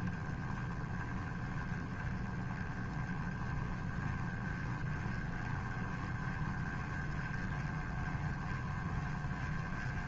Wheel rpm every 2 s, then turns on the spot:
10, 20, 20, 20, 20.
none